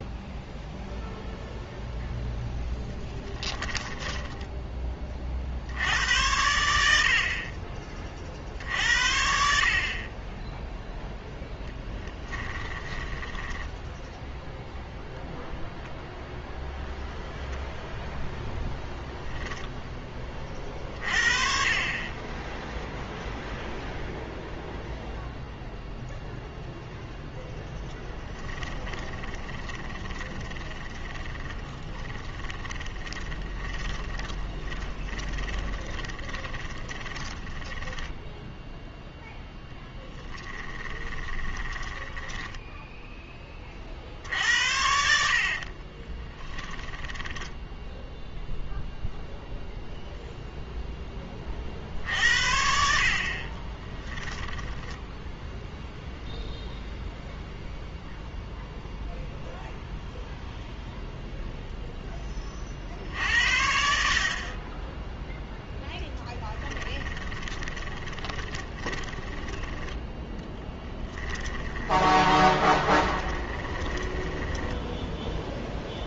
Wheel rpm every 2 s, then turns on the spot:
0, 10, 20, 80, 60, 0, 10, 0, 0, 0, 40, 10, 0, 0, 20, 30, 20, 20, 20, 0, 20, 10, 70, 20, 0, 0, 60, 10, 0, 0, 0, 50, 20, 10, 20, 10, 20, 10.
2-4 12-14 28-38 40-44 46-48 54-56 66-76